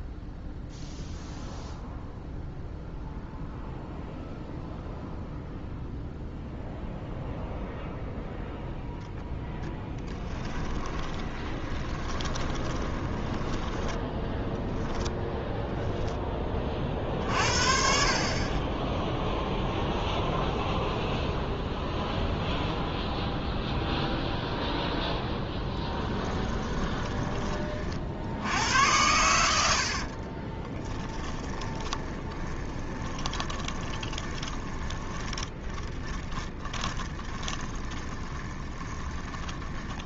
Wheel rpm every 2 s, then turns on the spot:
0, 0, 0, 0, 0, 10, 10, 0, 40, 10, 0, 0, 0, 10, 90, 20, 30, 30, 20, 20.
10-14 26-28 30-40